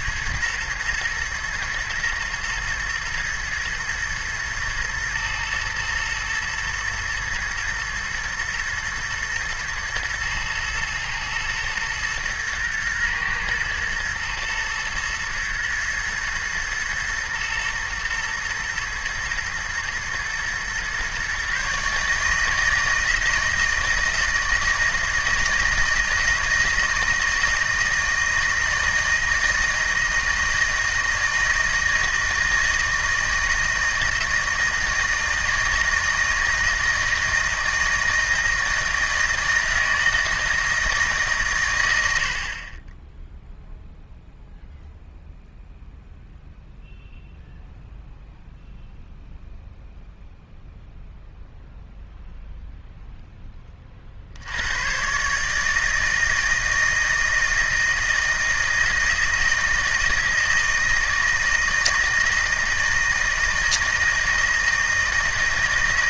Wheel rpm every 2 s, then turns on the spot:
120, 110, 110, 120, 110, 110, 120, 110, 110, 110, 120, 160, 160, 160, 160, 160, 160, 160, 160, 160, 160, 30, 0, 0, 0, 0, 0, 90, 160, 160, 160, 160, 160.
none